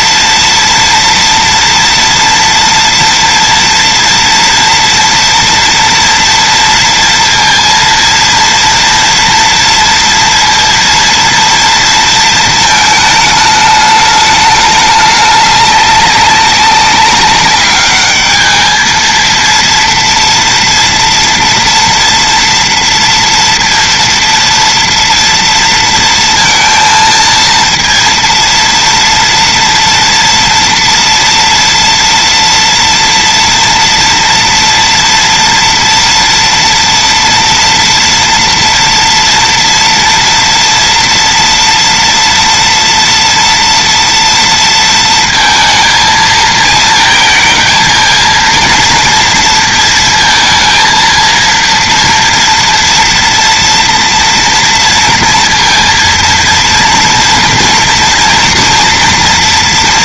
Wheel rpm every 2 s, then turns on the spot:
230, 230, 230, 230, 230, 230, 220, 210, 200, 220, 230, 230, 230, 230, 230, 230, 230, 230, 230, 230, 230, 230, 230, 220, 230, 230, 230, 230, 230, 240.
none